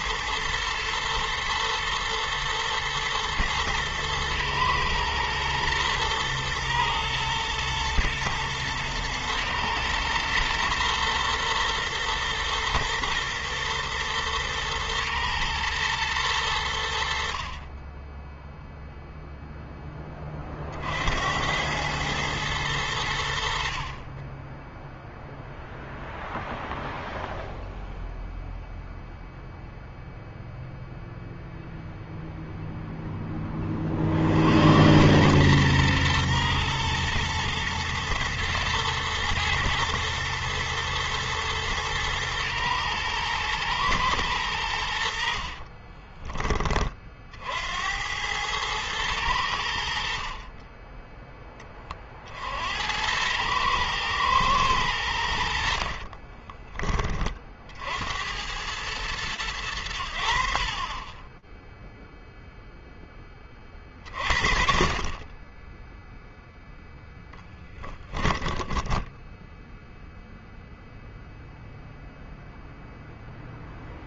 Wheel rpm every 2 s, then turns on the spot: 110, 110, 120, 120, 120, 120, 120, 120, 70, 0, 70, 90, 0, 0, 0, 0, 10, 100, 120, 110, 120, 120, 80, 40, 100, 20, 90, 90, 30, 110, 30, 10, 30, 10, 10, 0, 0.
44-46 66-70